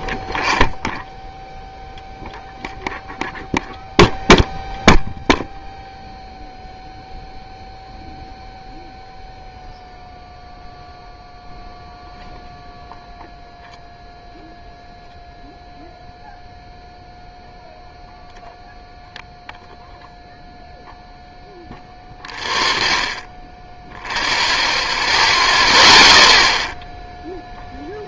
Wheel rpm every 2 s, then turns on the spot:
0, 0, 0, 0, 0, 0, 0, 0, 0, 0, 0, 0, 0, 0.
none